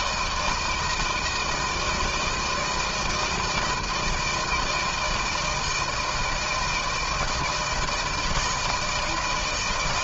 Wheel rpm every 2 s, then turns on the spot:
160, 160, 170, 160, 160.
none